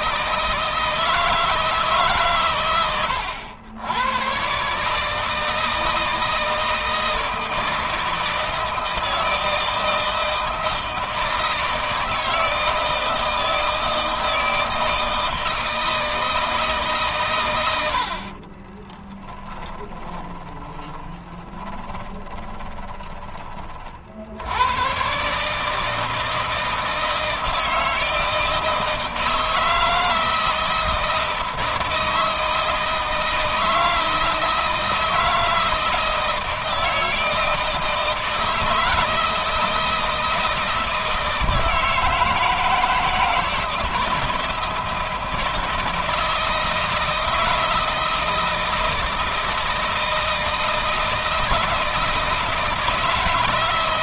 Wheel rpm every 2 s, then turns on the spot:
160, 110, 150, 160, 160, 160, 160, 160, 140, 10, 10, 20, 110, 160, 160, 160, 160, 160, 160, 160, 160, 160, 160, 160, 160, 160, 160.
18-22